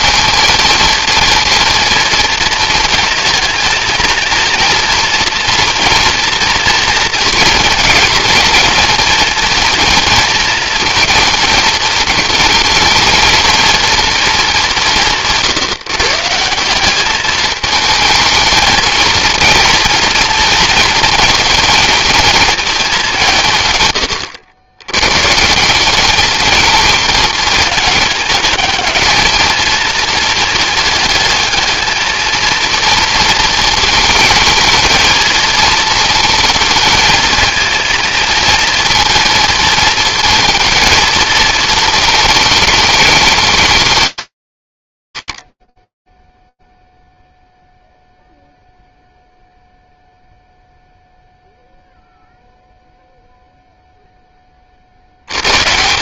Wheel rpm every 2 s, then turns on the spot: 230, 230, 230, 230, 230, 220, 220, 200, 180, 220, 230, 220, 100, 220, 210, 220, 230, 220, 220, 230, 220, 220, 180, 0, 0, 0, 0, 60.
none